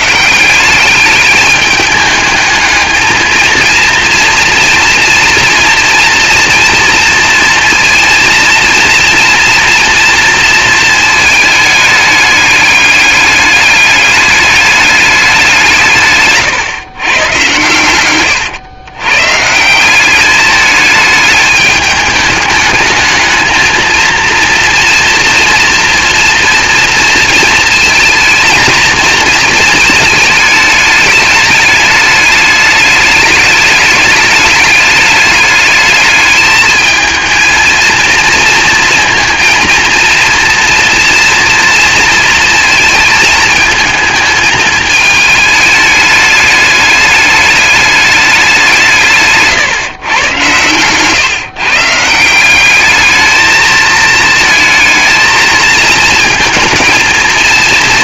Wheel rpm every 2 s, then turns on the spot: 200, 220, 230, 230, 230, 220, 200, 200, 130, 120, 210, 220, 230, 230, 230, 220, 210, 210, 220, 230, 230, 220, 220, 210, 170, 130, 210, 220, 220.
none